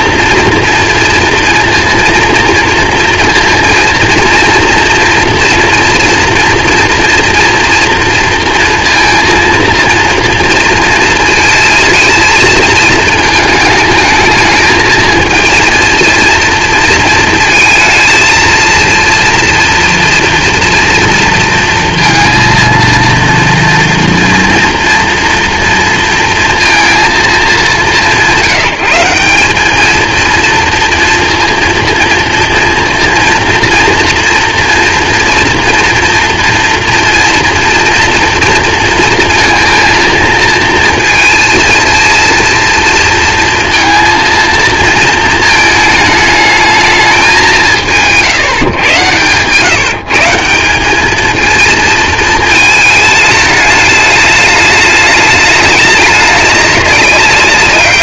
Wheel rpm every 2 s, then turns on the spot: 240, 230, 240, 230, 230, 230, 230, 220, 230, 230, 240, 230, 230, 230, 180, 210, 230, 240, 230, 240, 230, 220, 230, 220, 170, 160, 230, 210, 210.
none